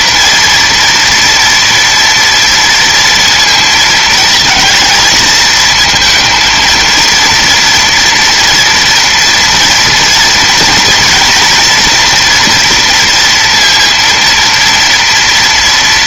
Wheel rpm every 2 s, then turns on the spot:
230, 230, 230, 220, 230, 230, 230, 230.
none